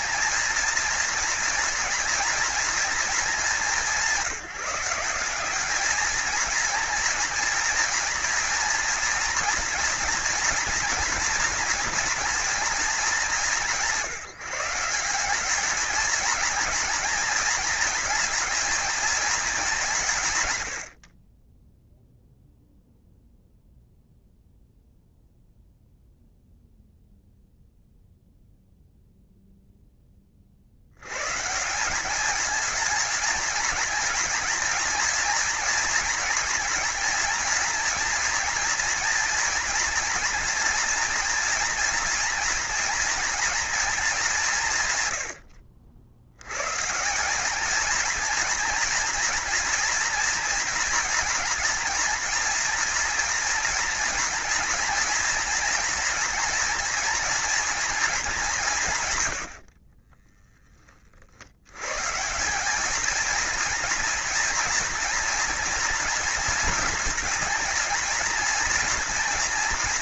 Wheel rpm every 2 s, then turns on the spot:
230, 230, 190, 230, 230, 230, 220, 180, 230, 220, 70, 0, 0, 0, 0, 80, 220, 230, 230, 230, 230, 240, 170, 150, 240, 230, 230, 230, 230, 150, 20, 200, 230, 220, 230.
none